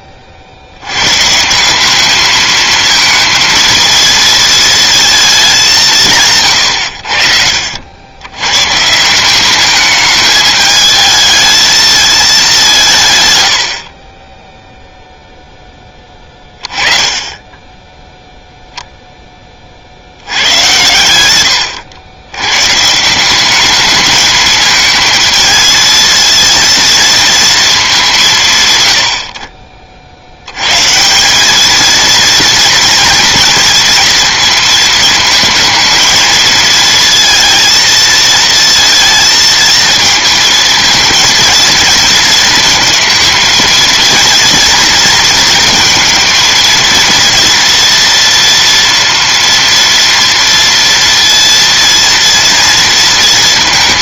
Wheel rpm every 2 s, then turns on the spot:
90, 220, 230, 120, 140, 220, 170, 0, 20, 10, 100, 190, 220, 230, 60, 180, 230, 220, 230, 220, 230, 220, 230, 230, 230, 230, 230.
none